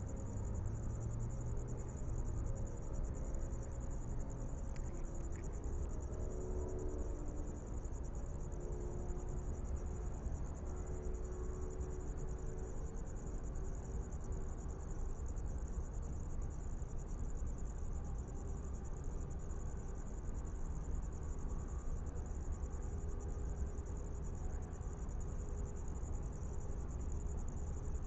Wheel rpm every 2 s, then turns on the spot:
0, 0, 0, 0, 0, 0, 0, 0, 0, 0, 0, 0, 0, 0.
none